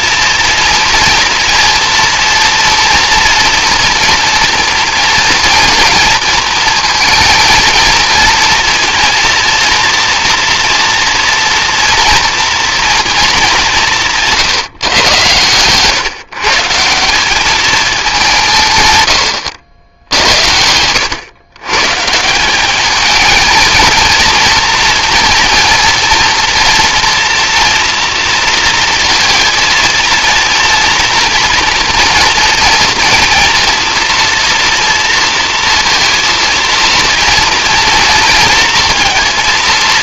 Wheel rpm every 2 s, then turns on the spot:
230, 230, 230, 230, 230, 240, 230, 140, 150, 140, 90, 180, 230, 230, 230, 230, 230, 230, 230, 220.
none